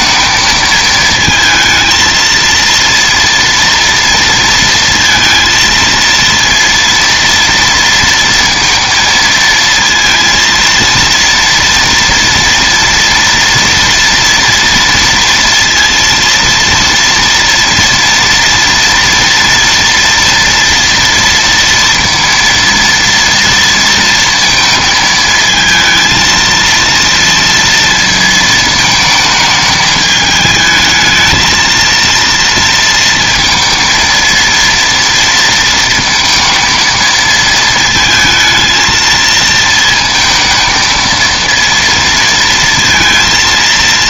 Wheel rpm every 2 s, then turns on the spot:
220, 230, 230, 230, 230, 230, 230, 230, 230, 230, 230, 230, 230, 230, 230, 220, 230, 230, 230, 220, 220, 230.
none